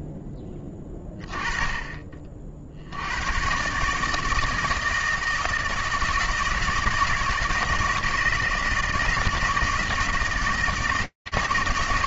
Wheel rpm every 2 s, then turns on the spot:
10, 120, 160, 160, 160, 160.
none